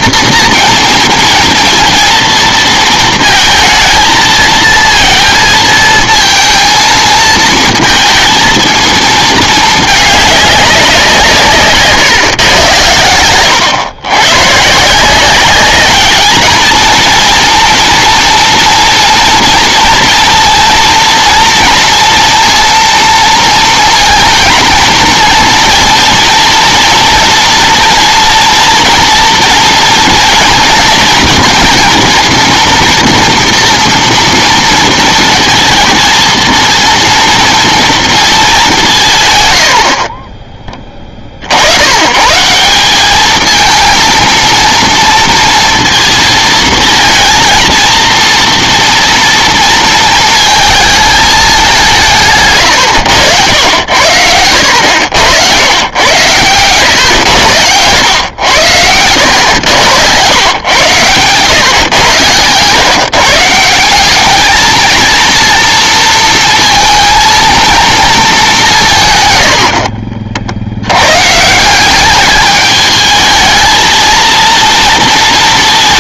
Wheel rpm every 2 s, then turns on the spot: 230, 220, 230, 230, 220, 190, 120, 150, 220, 230, 230, 230, 230, 230, 230, 230, 230, 230, 230, 190, 20, 190, 230, 220, 230, 220, 110, 90, 110, 100, 120, 130, 220, 230, 180, 90, 210, 230.
none